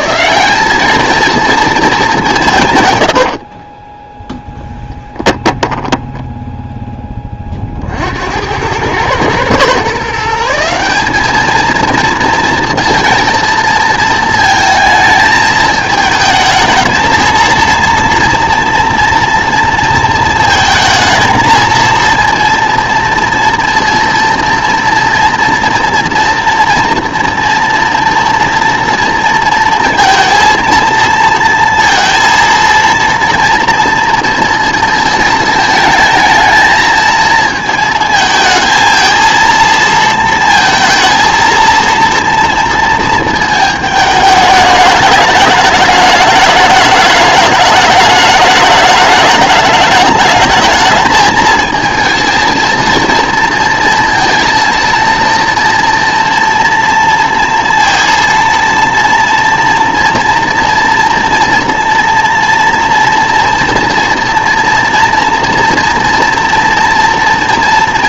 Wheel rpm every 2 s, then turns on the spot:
200, 110, 10, 10, 100, 180, 230, 220, 220, 230, 230, 230, 230, 230, 240, 230, 230, 230, 230, 220, 230, 230, 210, 210, 210, 220, 230, 230, 230, 230, 230, 230, 240, 230.
2-6